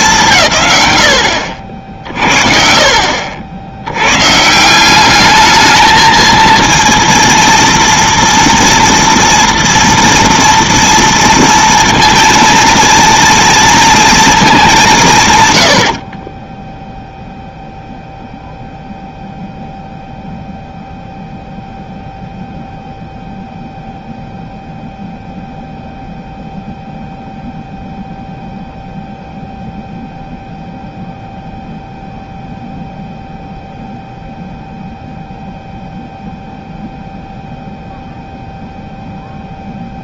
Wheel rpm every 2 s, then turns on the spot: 150, 50, 160, 230, 230, 230, 230, 210, 20, 0, 0, 0, 0, 0, 0, 0, 0, 0, 0, 0.
16-18